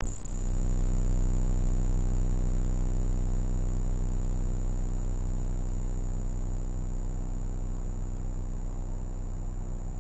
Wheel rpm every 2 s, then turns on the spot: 0, 0, 0, 0, 0.
none